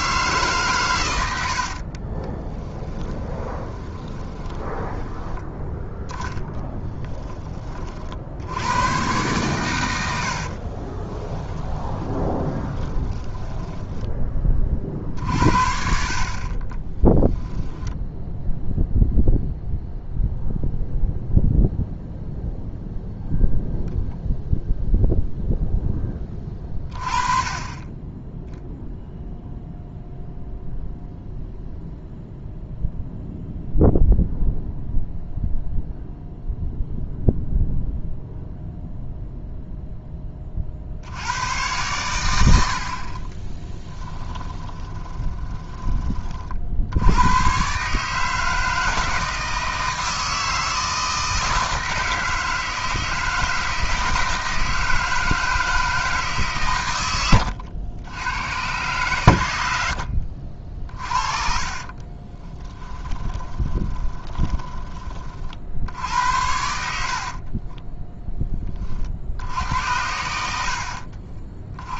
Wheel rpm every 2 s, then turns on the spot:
160, 20, 20, 10, 80, 60, 20, 20, 40, 10, 0, 0, 0, 20, 0, 0, 0, 0, 0, 0, 30, 90, 20, 40, 160, 160, 160, 160, 140, 100, 50, 20, 20, 80, 20, 80.
2-8 10-14 44-46 60-68